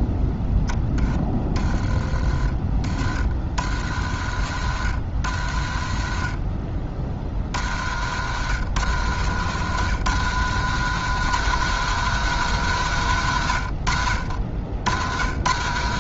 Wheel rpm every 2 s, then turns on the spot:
10, 30, 60, 40, 100, 130, 150, 80.
none